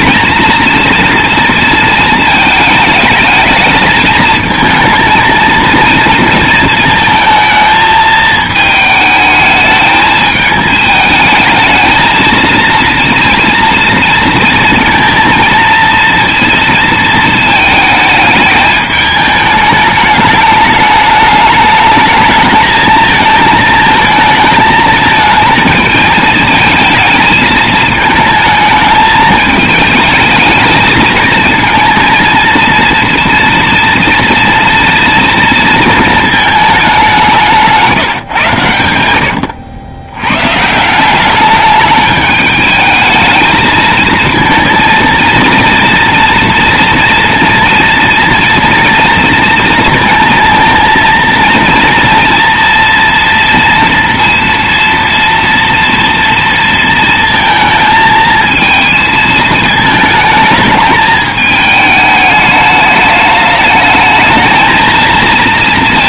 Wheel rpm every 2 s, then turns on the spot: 230, 220, 220, 220, 220, 220, 230, 230, 230, 210, 210, 220, 220, 220, 220, 220, 230, 230, 220, 120, 130, 210, 230, 230, 230, 230, 230, 230, 230, 220, 220, 210, 220.
none